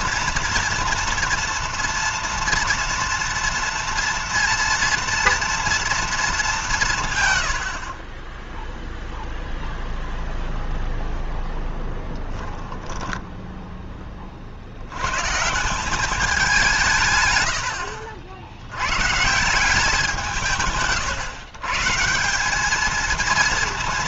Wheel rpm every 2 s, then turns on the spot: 230, 230, 230, 160, 0, 0, 10, 80, 160, 110, 130, 210.
none